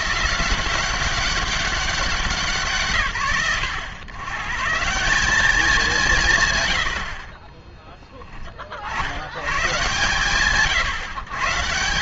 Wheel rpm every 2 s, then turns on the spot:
190, 120, 140, 100, 30, 120.
none